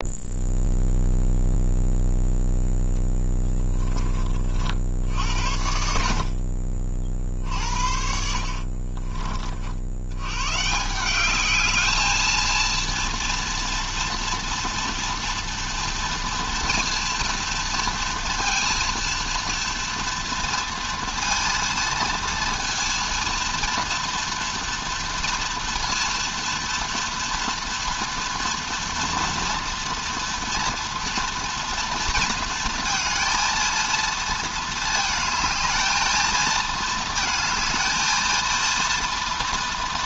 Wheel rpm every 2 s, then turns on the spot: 0, 0, 30, 60, 60, 110, 220, 230, 230, 230, 230, 230, 230, 230, 230, 230, 230, 230, 220, 220.
6-10